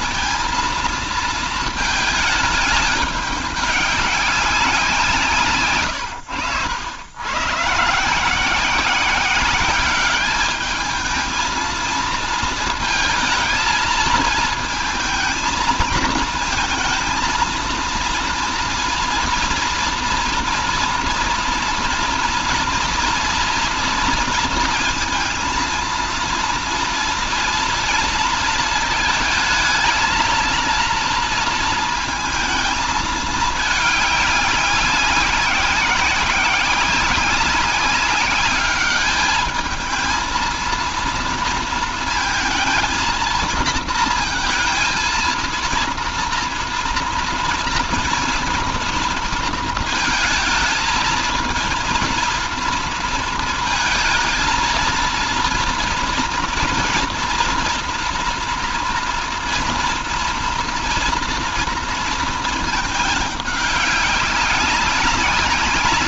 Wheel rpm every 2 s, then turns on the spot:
230, 210, 180, 100, 180, 210, 220, 230, 230, 230, 230, 230, 230, 240, 220, 230, 220, 190, 190, 210, 230, 230, 230, 240, 230, 230, 230, 230, 230, 230, 240, 220, 190.
none